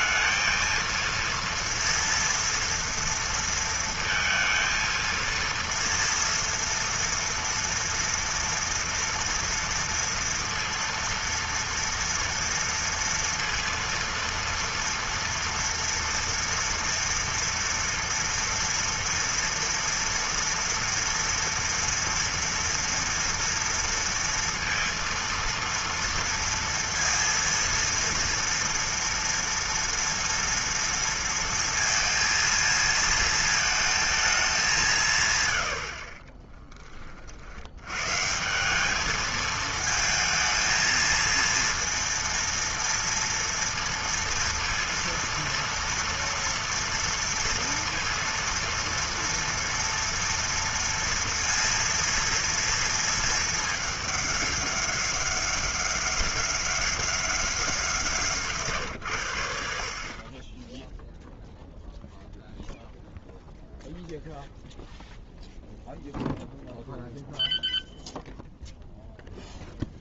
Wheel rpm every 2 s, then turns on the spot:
230, 230, 230, 230, 230, 230, 230, 230, 230, 230, 230, 230, 230, 230, 230, 230, 230, 220, 90, 100, 220, 230, 230, 230, 230, 230, 230, 220, 200, 180, 60, 0, 0, 0, 0.
none